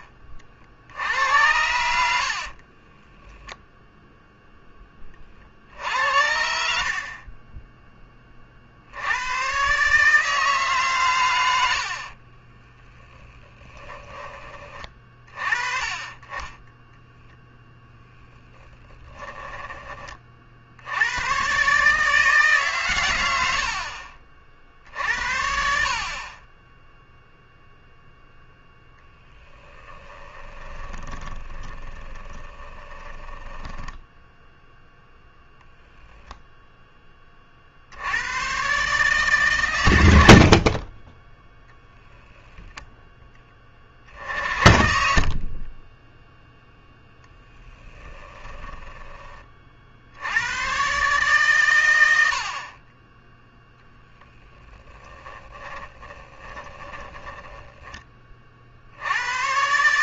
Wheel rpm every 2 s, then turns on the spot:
60, 30, 10, 60, 70, 140, 10, 30, 10, 20, 80, 130, 60, 10, 0, 20, 20, 0, 10, 130, 40, 0, 50, 0, 10, 120, 30, 10, 10, 50.
2-4 12-14 18-20 30-34 44-46 48-50 54-58